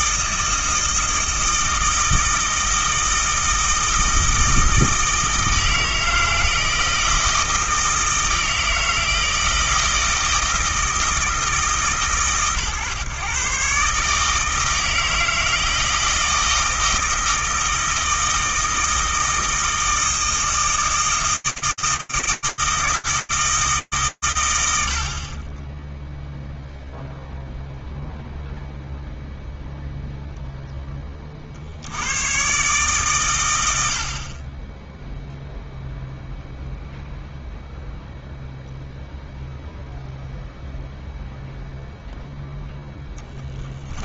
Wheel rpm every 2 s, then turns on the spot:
160, 160, 160, 160, 160, 160, 130, 160, 160, 160, 160, 160, 110, 0, 0, 40, 100, 0, 0, 0, 0, 30.
42-44